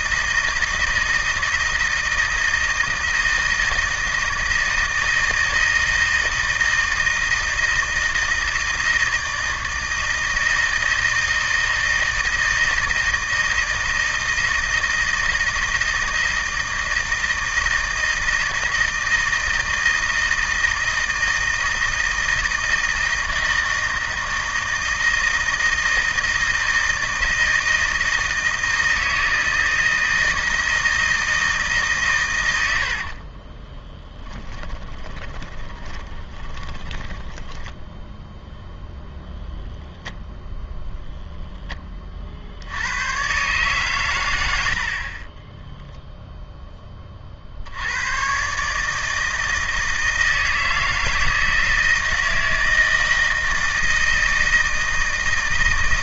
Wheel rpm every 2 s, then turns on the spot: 160, 160, 160, 160, 160, 160, 160, 160, 160, 160, 160, 160, 160, 160, 160, 160, 100, 20, 20, 0, 0, 60, 80, 10, 140, 160, 160, 160.
32-38